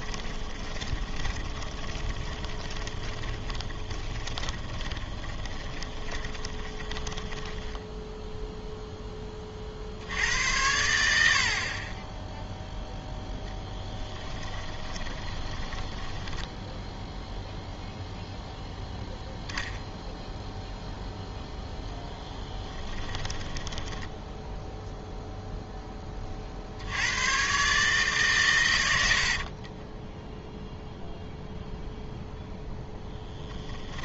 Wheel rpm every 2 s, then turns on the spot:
10, 20, 20, 20, 0, 90, 0, 20, 10, 10, 0, 10, 0, 60, 100, 0, 0.
0-8 14-18 22-24